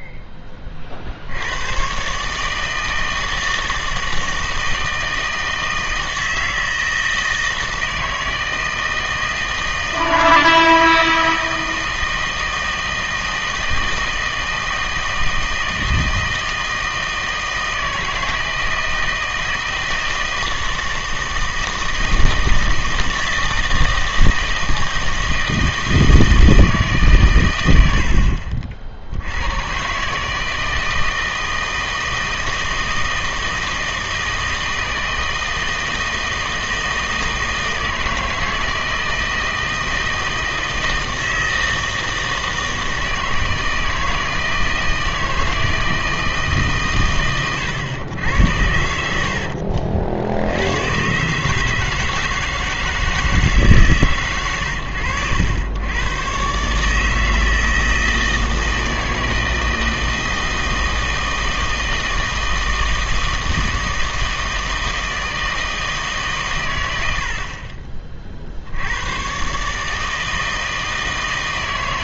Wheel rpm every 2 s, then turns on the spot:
30, 160, 160, 160, 160, 160, 160, 160, 160, 160, 160, 160, 160, 160, 50, 160, 160, 160, 160, 160, 160, 160, 160, 140, 90, 100, 160, 110, 140, 160, 160, 160, 160, 120, 70, 160.
none